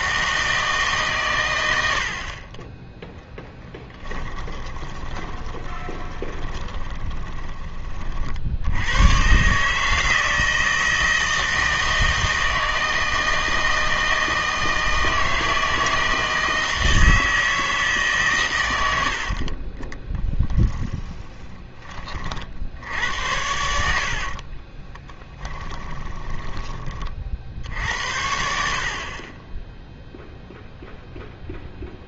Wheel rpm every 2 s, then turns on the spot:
160, 20, 20, 20, 70, 160, 160, 160, 160, 100, 10, 60, 30, 20, 50, 0.
4-8 20-22 24-26